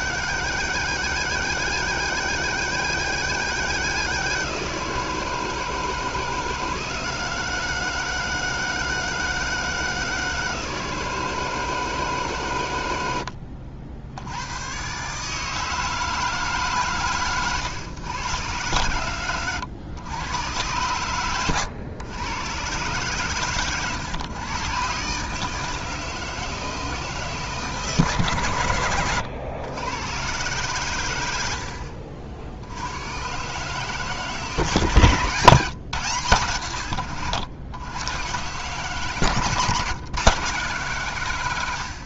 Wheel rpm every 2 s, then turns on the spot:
160, 160, 160, 160, 160, 160, 100, 120, 140, 110, 110, 120, 130, 160, 110, 100, 90, 140, 90, 140, 140.
none